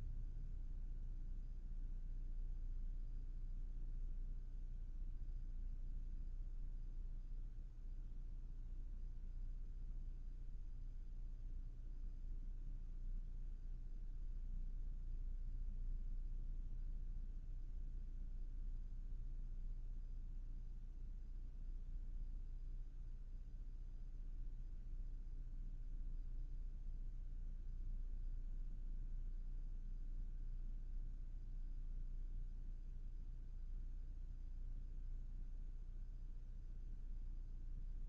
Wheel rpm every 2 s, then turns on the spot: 0, 0, 0, 0, 0, 0, 0, 0, 0, 0, 0, 0, 0, 0, 0, 0, 0, 0, 0.
none